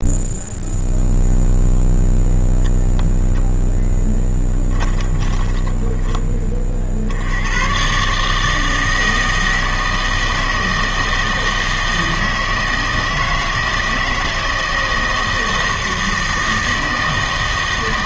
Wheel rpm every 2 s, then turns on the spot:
0, 0, 20, 40, 160, 160, 160, 160, 160.
4-6